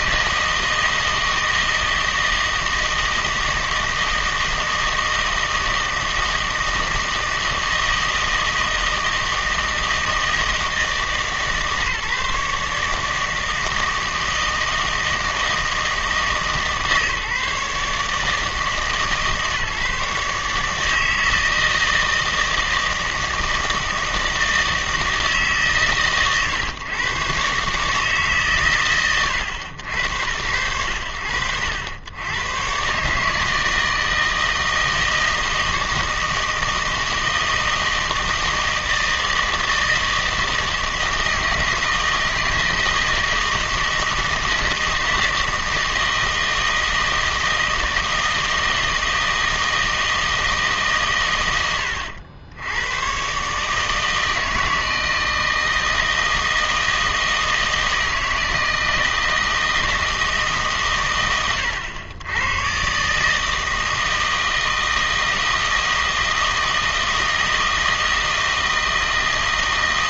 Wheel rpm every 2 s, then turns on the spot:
160, 160, 160, 160, 160, 160, 150, 160, 150, 150, 160, 160, 160, 130, 120, 90, 130, 160, 160, 160, 160, 160, 160, 160, 160, 150, 100, 160, 160, 160, 140, 120, 160, 160, 160.
none